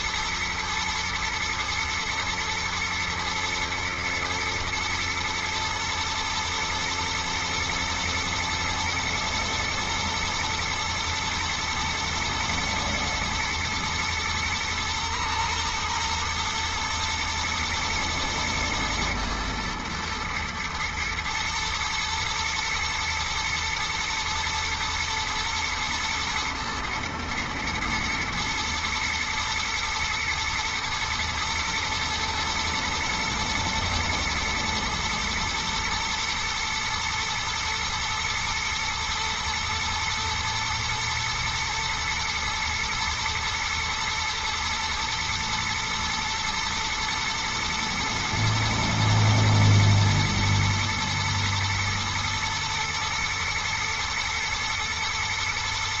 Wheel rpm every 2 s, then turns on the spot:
120, 120, 120, 110, 110, 110, 120, 120, 120, 120, 120, 120, 120, 110, 110, 110, 120, 120, 110, 110, 120, 120, 120, 110, 110, 110, 110, 120.
none